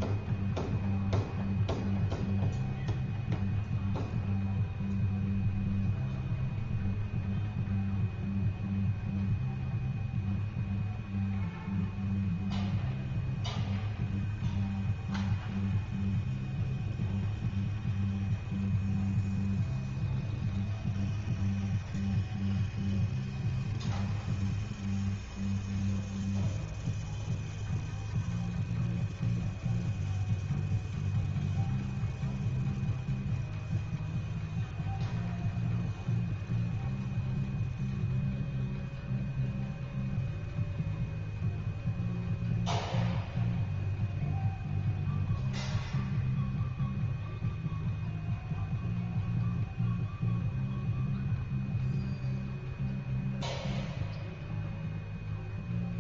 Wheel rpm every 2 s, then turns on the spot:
0, 0, 0, 0, 0, 0, 0, 0, 0, 0, 0, 0, 0, 0, 0, 0, 0, 0, 0, 0, 0, 0, 0, 0, 0, 0, 0, 0.
none